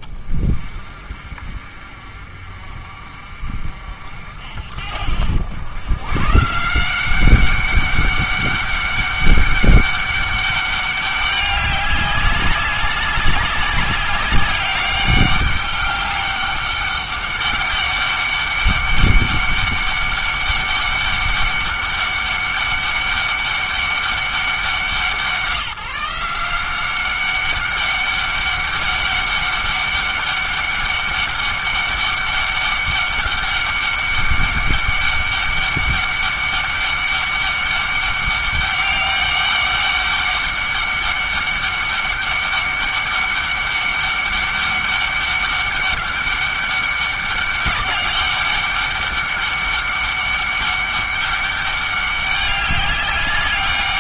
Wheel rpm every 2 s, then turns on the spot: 40, 50, 60, 160, 200, 200, 200, 200, 200, 200, 200, 200, 190, 180, 200, 200, 200, 200, 200, 200, 200, 200, 200, 200, 200, 200, 200.
none